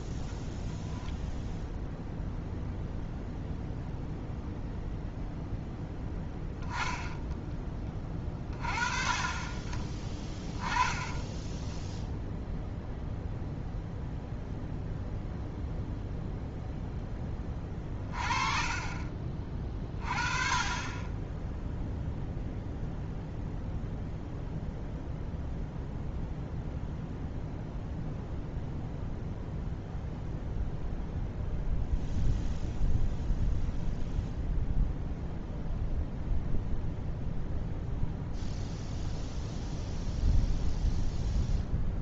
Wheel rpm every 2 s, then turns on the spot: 0, 0, 0, 10, 20, 20, 0, 0, 0, 30, 30, 0, 0, 0, 0, 0, 0, 0, 0, 0, 0.
18-20